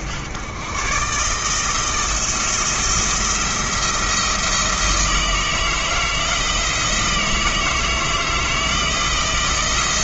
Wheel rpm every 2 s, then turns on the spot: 120, 170, 160, 160, 170.
none